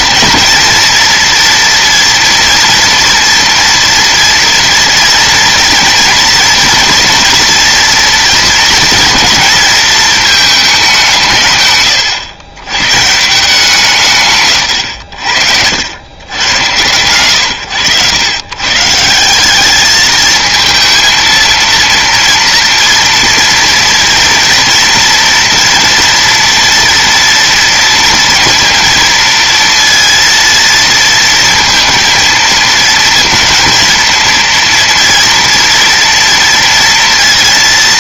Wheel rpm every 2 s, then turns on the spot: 230, 230, 230, 230, 230, 210, 110, 130, 110, 130, 220, 230, 230, 230, 230, 230, 230, 230, 230.
14-16